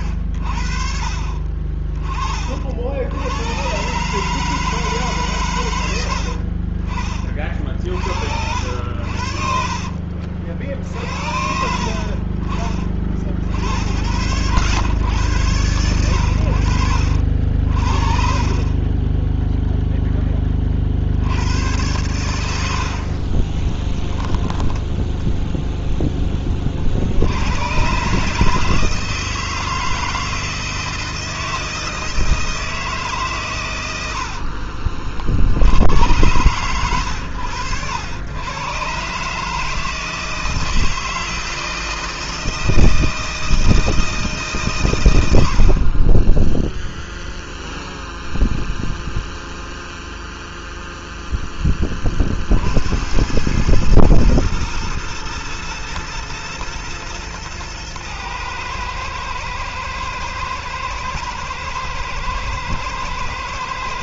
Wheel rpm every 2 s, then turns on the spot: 40, 70, 150, 50, 70, 60, 40, 100, 60, 20, 60, 50, 10, 60, 160, 160, 150, 60, 110, 130, 160, 160, 110, 0, 0, 0, 80, 110, 110, 110, 120, 110.
22-24